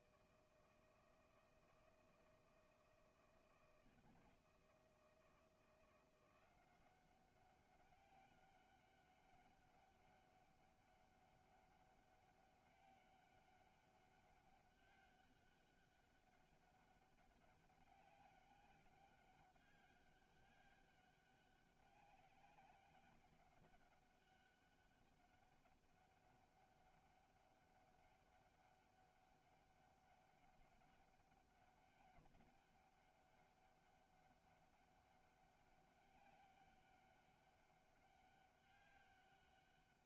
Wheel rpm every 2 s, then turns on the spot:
160, 160, 160, 180, 200, 200, 200, 200, 200, 200, 200, 200, 200, 200, 200, 200, 200, 200, 200, 200.
none